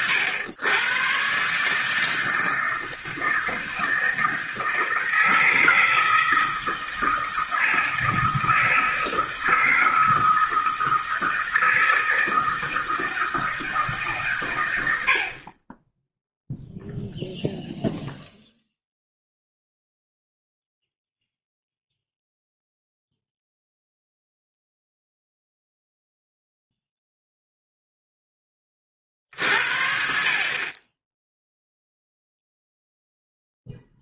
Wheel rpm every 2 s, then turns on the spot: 110, 160, 160, 160, 160, 160, 160, 110, 0, 0, 0, 0, 0, 0, 20, 40, 0.
none